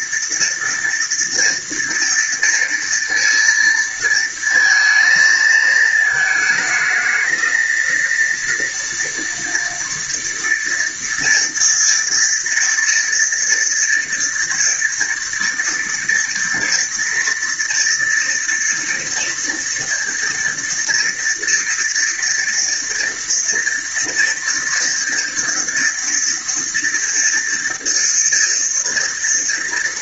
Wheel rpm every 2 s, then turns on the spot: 230, 230, 230, 220, 230, 230, 230, 230, 230, 230, 230, 230, 230, 230, 230.
none